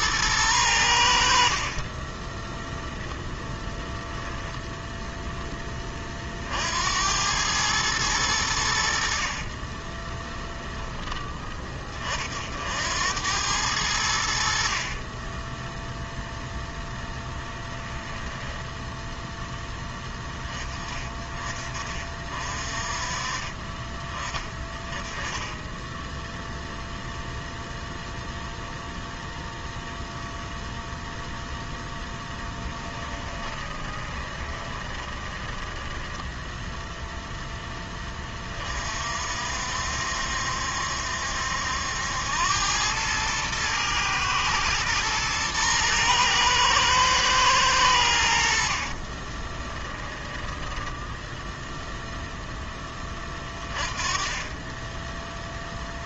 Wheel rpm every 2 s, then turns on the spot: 70, 10, 0, 90, 60, 10, 80, 40, 0, 0, 20, 30, 20, 0, 0, 0, 10, 20, 0, 50, 70, 100, 110, 110, 40, 10, 20, 10.
8-10 14-16 32-36 48-50